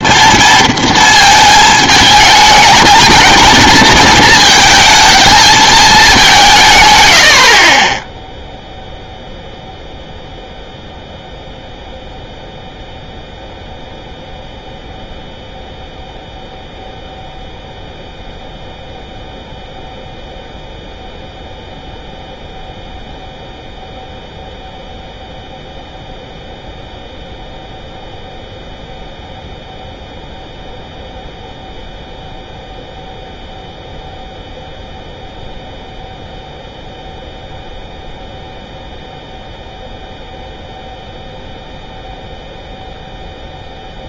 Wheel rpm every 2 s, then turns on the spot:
230, 220, 220, 150, 0, 0, 0, 0, 0, 0, 0, 0, 0, 0, 0, 0, 0, 0, 0, 0, 0, 0.
none